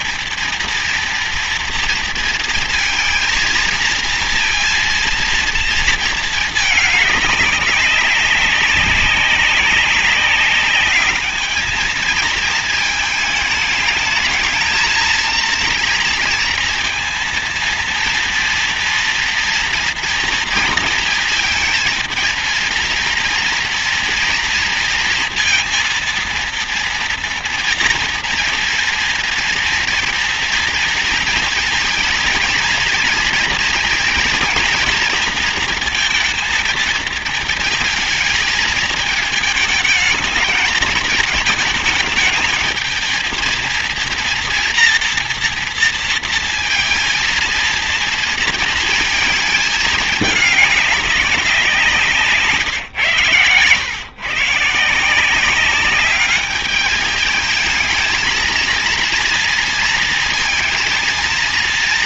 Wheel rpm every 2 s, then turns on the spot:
230, 230, 230, 210, 200, 210, 220, 230, 230, 230, 230, 230, 230, 230, 230, 230, 230, 230, 220, 220, 220, 230, 230, 230, 230, 190, 120, 180, 210, 230, 230.
none